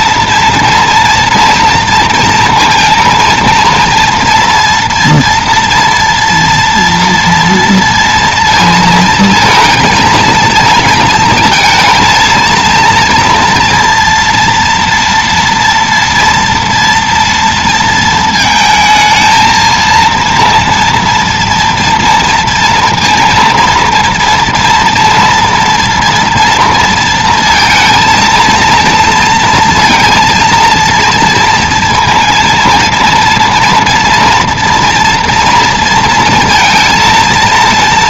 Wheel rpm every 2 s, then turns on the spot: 230, 230, 230, 230, 230, 230, 230, 230, 230, 220, 230, 230, 230, 230, 230, 230, 230, 230, 230.
none